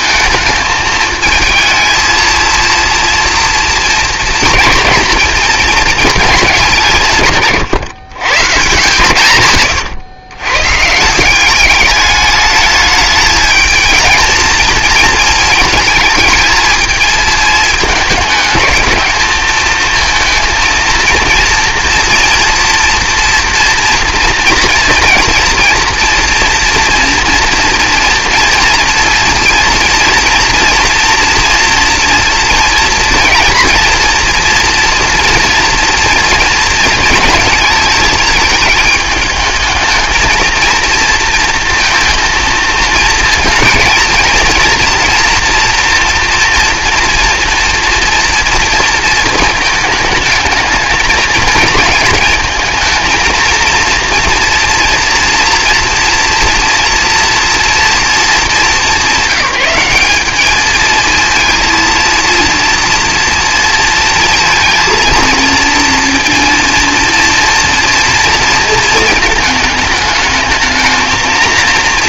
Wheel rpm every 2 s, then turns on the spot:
220, 230, 220, 180, 130, 130, 210, 220, 220, 210, 230, 230, 230, 240, 230, 240, 230, 240, 230, 220, 230, 230, 230, 230, 230, 220, 220, 240, 240, 210, 220, 230, 230, 230, 230, 220.
none